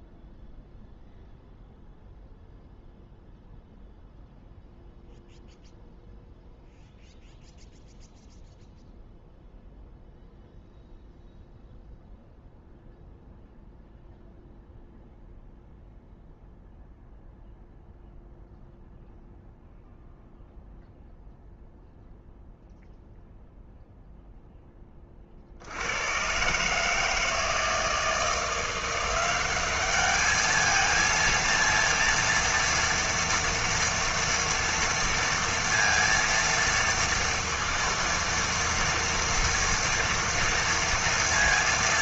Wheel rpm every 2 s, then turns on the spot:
0, 0, 0, 0, 0, 0, 0, 0, 0, 0, 0, 0, 10, 140, 170, 220, 230, 230, 230, 230, 230.
none